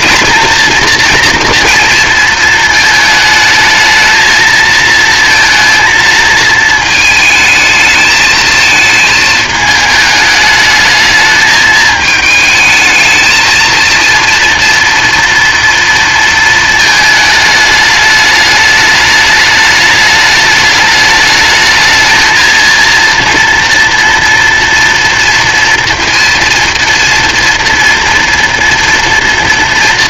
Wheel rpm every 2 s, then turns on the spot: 230, 230, 220, 230, 220, 210, 220, 230, 230, 210, 210, 230, 230, 230, 230.
none